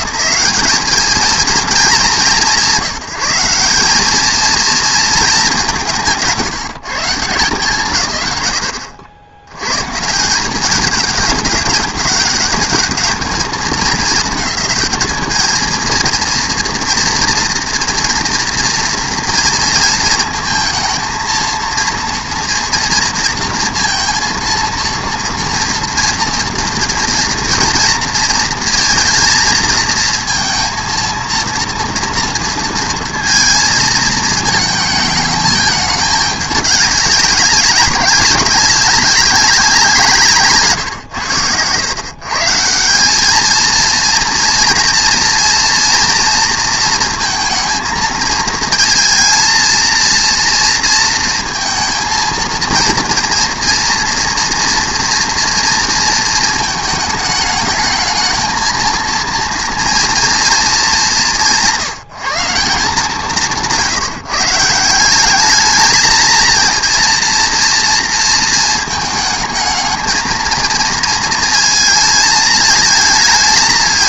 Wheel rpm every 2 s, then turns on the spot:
200, 150, 230, 190, 110, 200, 200, 220, 230, 230, 220, 230, 230, 230, 230, 230, 230, 220, 210, 190, 150, 160, 230, 230, 220, 230, 230, 230, 220, 220, 230, 180, 160, 230, 220, 220, 220.
none